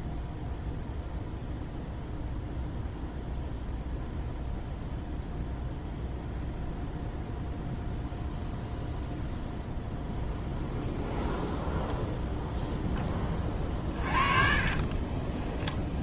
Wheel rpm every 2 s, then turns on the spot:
0, 0, 0, 0, 0, 0, 10, 40.
14-16